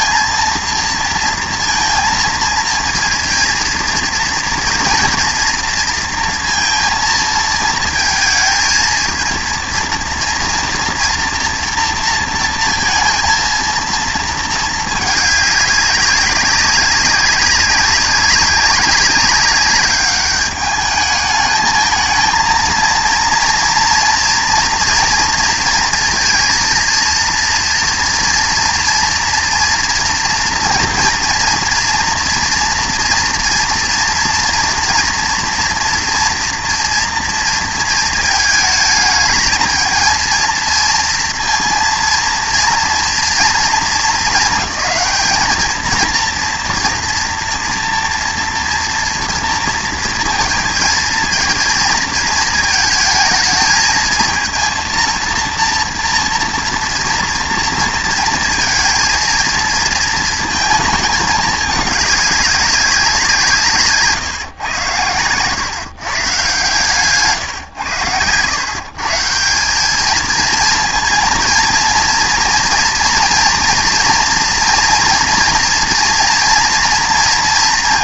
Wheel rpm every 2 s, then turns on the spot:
230, 230, 230, 230, 220, 240, 230, 220, 190, 190, 200, 230, 240, 230, 230, 230, 230, 230, 230, 220, 230, 230, 220, 230, 230, 230, 220, 230, 230, 230, 220, 200, 110, 150, 130, 230, 230, 230, 230.
none